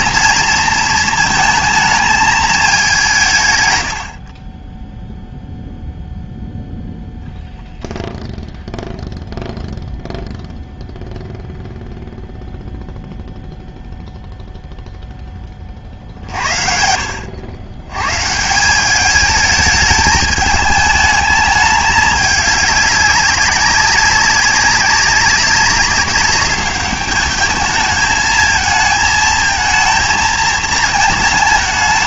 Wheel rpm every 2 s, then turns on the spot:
230, 190, 10, 10, 0, 0, 0, 0, 60, 190, 210, 210, 200, 210, 220, 220.
none